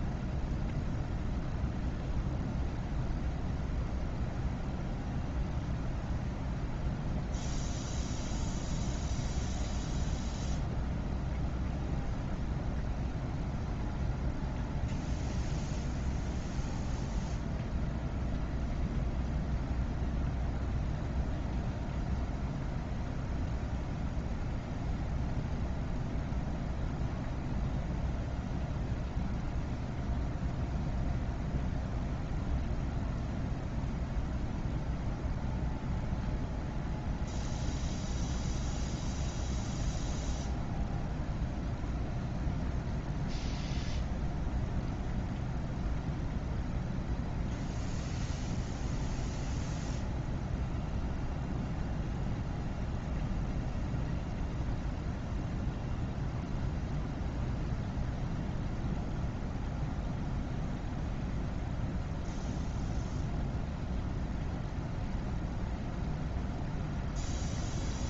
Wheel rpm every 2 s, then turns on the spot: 0, 0, 0, 0, 0, 0, 0, 0, 0, 0, 0, 0, 0, 0, 0, 0, 0, 0, 0, 0, 0, 0, 0, 0, 0, 0, 0, 0, 0, 0, 0, 0, 0, 0.
none